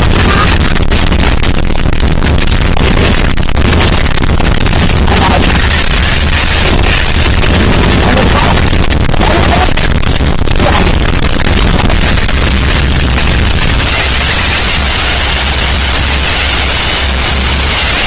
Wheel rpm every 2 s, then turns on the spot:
20, 20, 20, 60, 20, 20, 80, 170, 200.
0-12